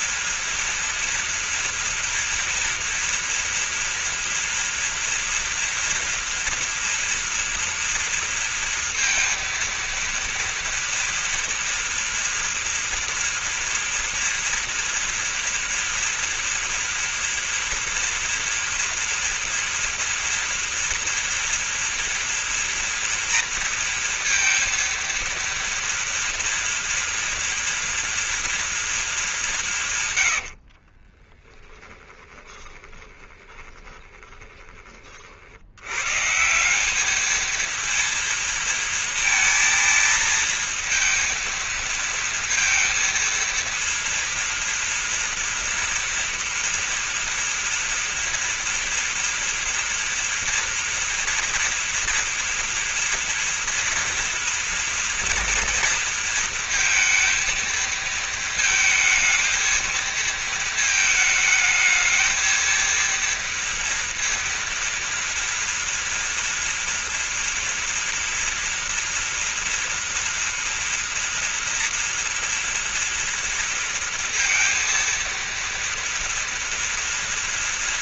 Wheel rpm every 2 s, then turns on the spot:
230, 230, 230, 230, 230, 230, 230, 230, 230, 230, 230, 230, 230, 230, 230, 50, 20, 20, 190, 230, 230, 230, 230, 240, 230, 240, 230, 230, 230, 230, 220, 230, 230, 230, 230, 240, 230, 230, 230.
30-34